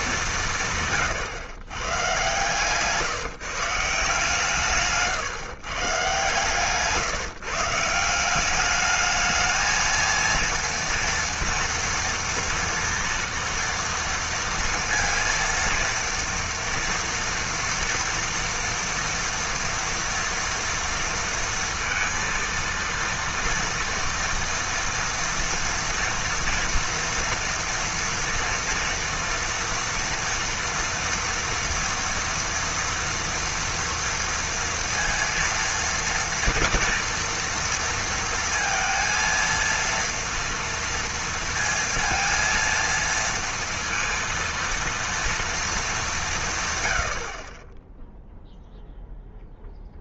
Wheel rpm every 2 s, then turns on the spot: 140, 140, 160, 150, 200, 230, 230, 230, 230, 230, 230, 230, 230, 230, 230, 230, 230, 230, 230, 230, 230, 230, 230, 140, 0.
none